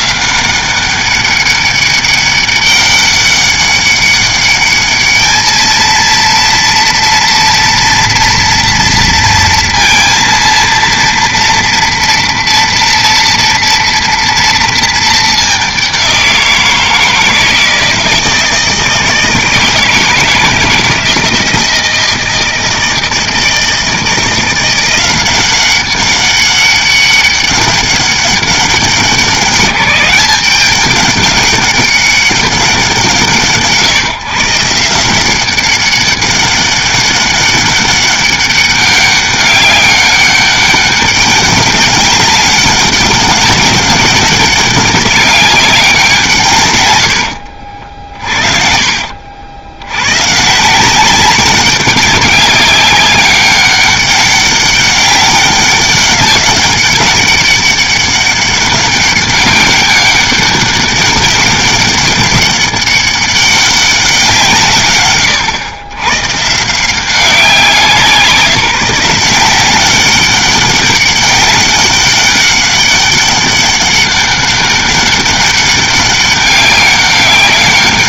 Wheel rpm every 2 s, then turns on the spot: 190, 200, 210, 230, 230, 230, 230, 220, 170, 160, 160, 160, 180, 200, 190, 200, 180, 160, 200, 200, 200, 200, 190, 110, 50, 170, 190, 200, 200, 200, 200, 200, 140, 170, 170, 200, 200, 200, 200.
48-50